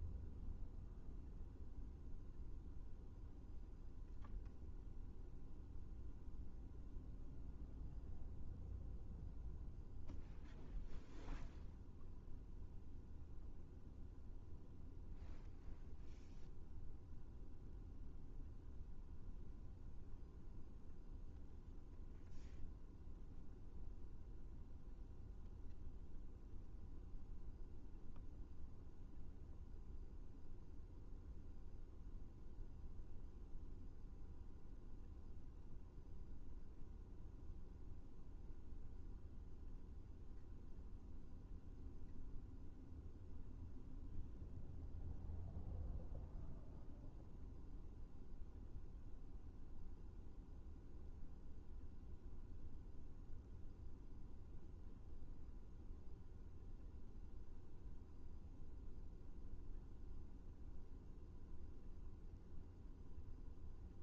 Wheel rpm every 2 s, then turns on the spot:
0, 0, 0, 0, 0, 0, 0, 0, 0, 0, 0, 0, 0, 0, 0, 0, 0, 0, 0, 0, 0, 0, 0, 0, 0, 0, 0, 0, 0, 0, 0, 0.
none